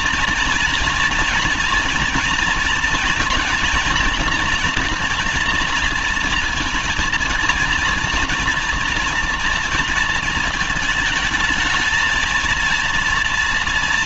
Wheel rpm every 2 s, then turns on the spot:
230, 230, 230, 230, 240, 220, 220.
none